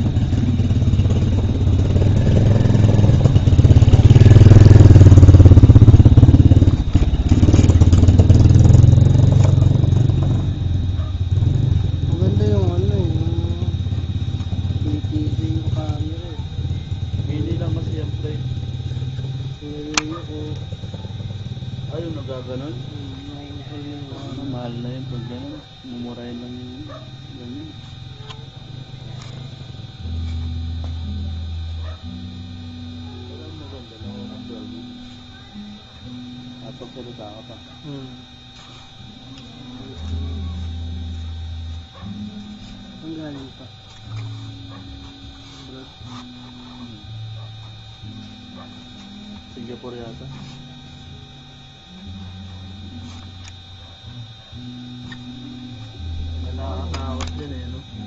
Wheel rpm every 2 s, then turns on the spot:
0, 0, 0, 0, 0, 0, 0, 0, 0, 0, 0, 0, 0, 0, 0, 0, 0, 0, 0, 0, 0, 0, 0, 0, 0, 0, 0, 0, 0.
none